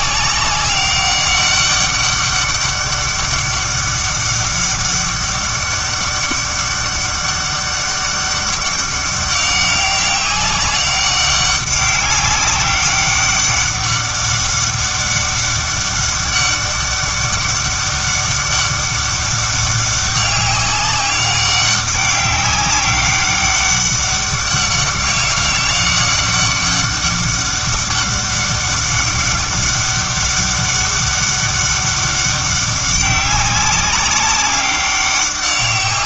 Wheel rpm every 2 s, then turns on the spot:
200, 200, 200, 200, 200, 190, 200, 200, 200, 200, 200, 200, 200, 200, 200, 200, 190, 200.
none